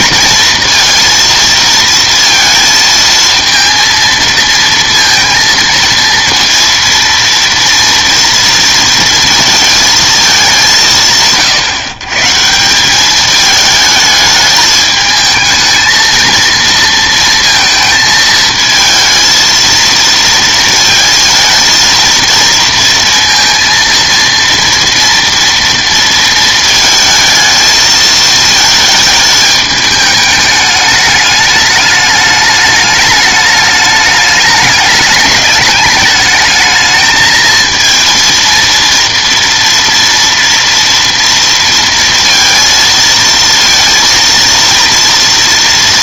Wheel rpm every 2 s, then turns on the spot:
230, 230, 230, 230, 230, 190, 160, 220, 230, 220, 230, 230, 230, 220, 220, 210, 210, 210, 220, 230, 230, 230, 230.
none